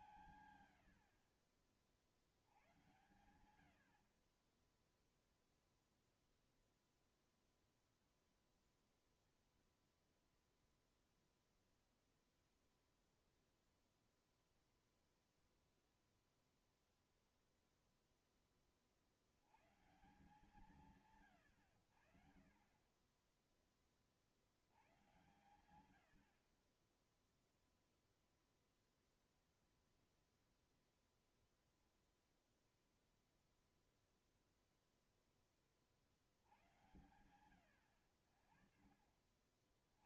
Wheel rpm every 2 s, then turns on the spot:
170, 60, 50, 0, 0, 0, 0, 0, 0, 10, 140, 80, 40, 70, 0, 0, 0, 0, 60, 80.
none